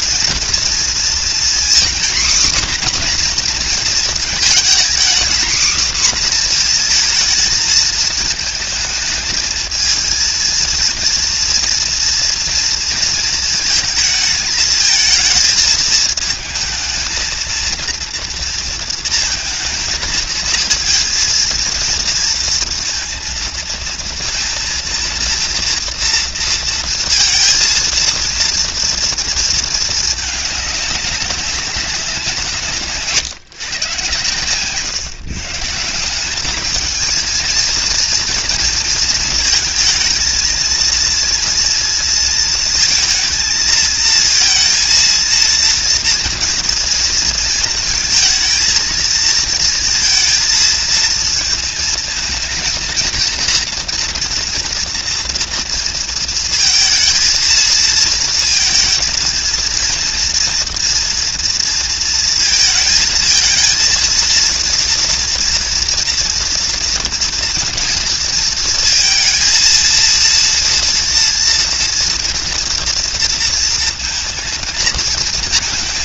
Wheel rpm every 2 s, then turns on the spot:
230, 260, 230, 250, 220, 230, 230, 220, 220, 230, 220, 230, 230, 230, 230, 220, 160, 140, 210, 230, 230, 230, 230, 230, 220, 230, 230, 230, 230, 230, 240, 230, 230, 230, 230, 230, 230, 230.
34-36